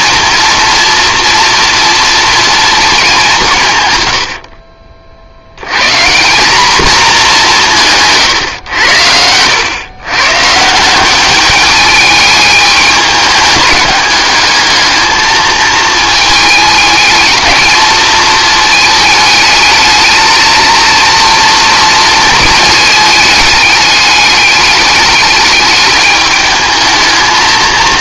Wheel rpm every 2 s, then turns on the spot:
230, 230, 60, 220, 100, 160, 210, 210, 220, 220, 220, 220, 210, 220.
4-6